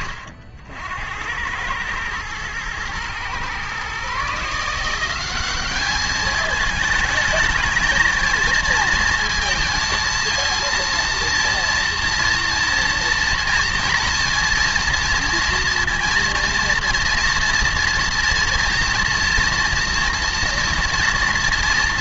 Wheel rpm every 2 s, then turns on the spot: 70, 110, 160, 220, 220, 230, 230, 230, 230, 230, 230.
none